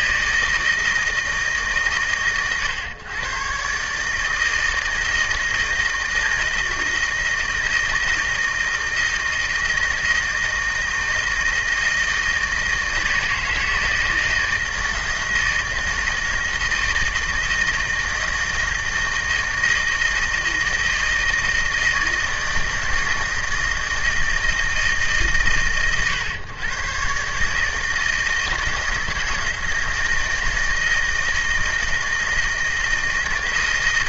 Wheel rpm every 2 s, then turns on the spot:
160, 110, 160, 160, 160, 160, 160, 160, 160, 160, 160, 160, 140, 130, 160, 160, 160.
none